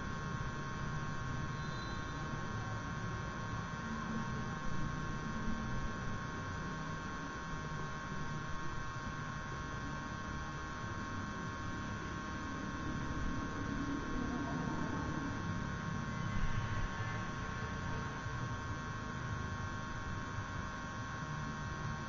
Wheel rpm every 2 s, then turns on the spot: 0, 0, 0, 0, 0, 0, 0, 0, 0, 0, 0.
none